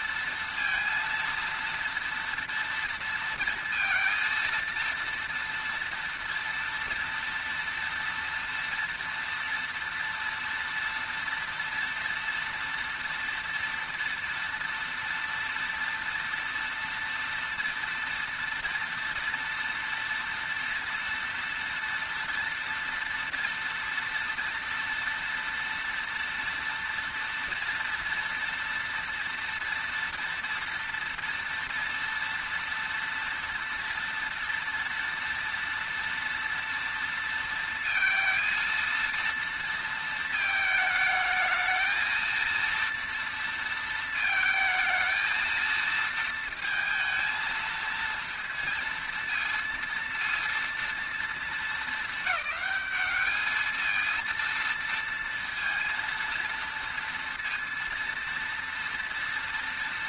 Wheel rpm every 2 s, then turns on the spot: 230, 230, 230, 230, 230, 230, 230, 230, 230, 230, 230, 230, 240, 230, 240, 230, 230, 230, 230, 230, 220, 230, 220, 230, 230, 230, 210, 230, 230, 230.
none